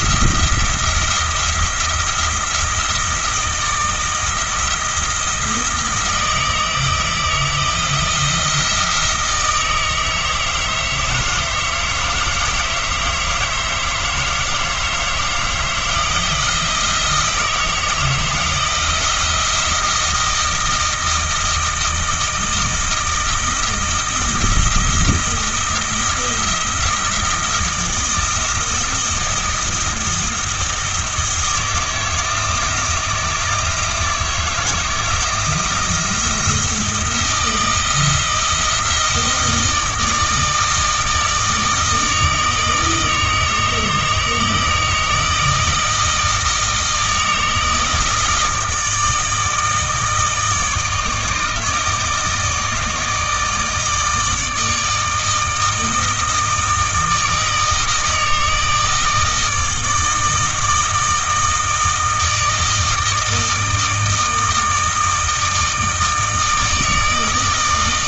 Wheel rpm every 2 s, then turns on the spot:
170, 170, 170, 160, 160, 160, 160, 160, 160, 160, 160, 160, 170, 170, 170, 170, 160, 160, 170, 160, 160, 160, 160, 160, 160, 160, 160, 160, 160, 160, 160, 160, 160, 160.
none